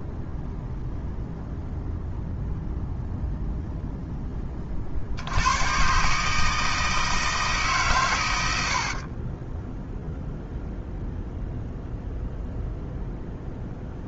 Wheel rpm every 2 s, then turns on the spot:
0, 0, 50, 160, 40, 0, 0.
8-10